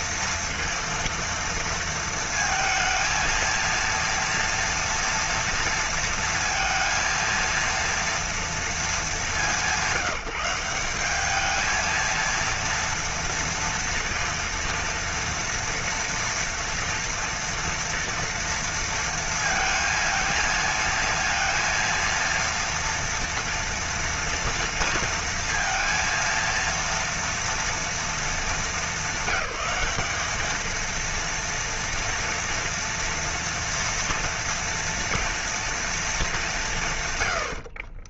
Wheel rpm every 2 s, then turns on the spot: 230, 220, 230, 230, 220, 180, 230, 230, 230, 230, 230, 230, 230, 230, 220, 220, 230, 230, 170.
none